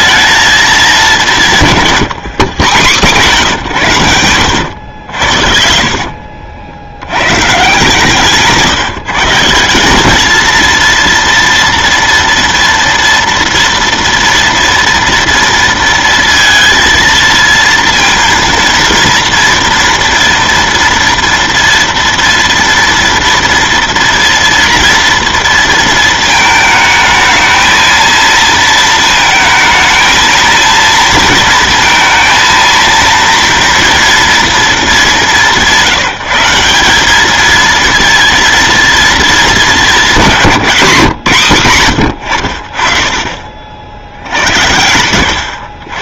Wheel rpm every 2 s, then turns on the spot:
210, 140, 80, 60, 150, 230, 230, 230, 230, 230, 230, 230, 230, 220, 230, 230, 230, 220, 180, 230, 180, 70, 80.
4-6 42-44